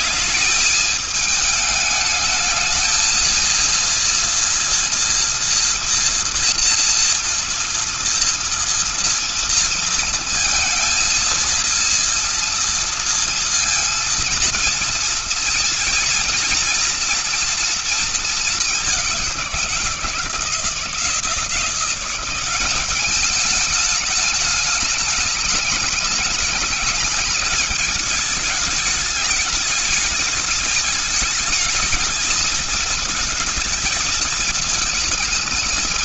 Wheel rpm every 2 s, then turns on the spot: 220, 220, 230, 230, 230, 230, 230, 230, 230, 200, 160, 200, 210, 210, 210, 220, 220, 220.
none